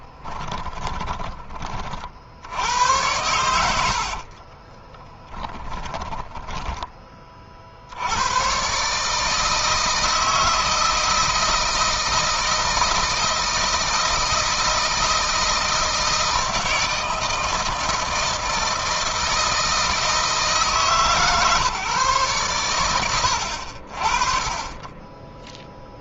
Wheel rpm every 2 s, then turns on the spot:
20, 80, 10, 20, 130, 160, 160, 160, 160, 170, 150, 110, 20.
0-6